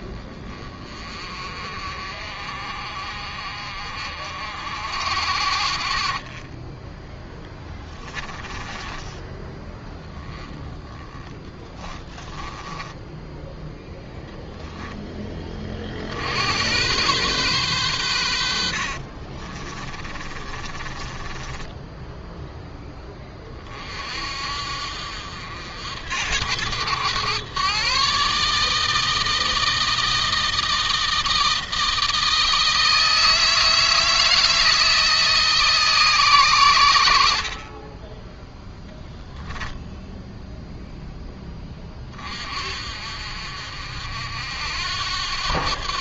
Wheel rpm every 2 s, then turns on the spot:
30, 50, 60, 10, 20, 10, 10, 10, 100, 50, 20, 10, 60, 110, 160, 160, 160, 160, 100, 0, 0, 50, 80.
8-12 18-22